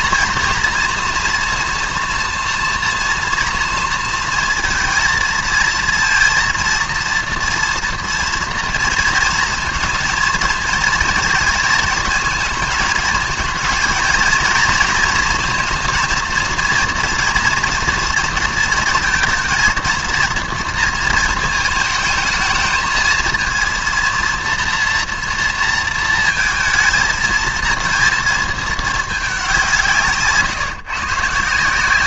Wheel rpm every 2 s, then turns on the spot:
230, 230, 230, 230, 230, 220, 220, 230, 240, 230, 230, 220, 230, 230, 220, 150.
none